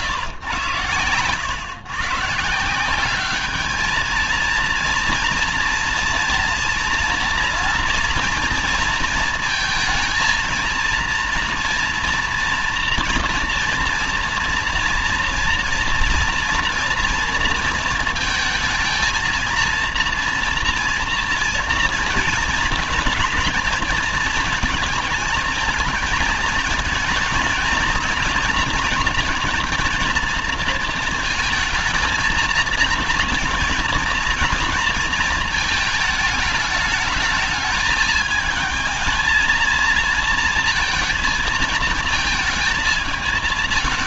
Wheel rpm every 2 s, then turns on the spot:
120, 150, 230, 230, 230, 230, 240, 230, 230, 230, 230, 220, 220, 220, 230, 230, 230, 230, 210, 220, 220, 220.
none